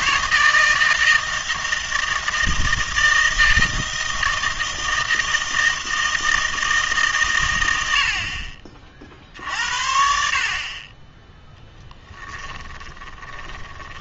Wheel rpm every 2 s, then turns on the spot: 160, 160, 160, 160, 50, 30, 20.
12-14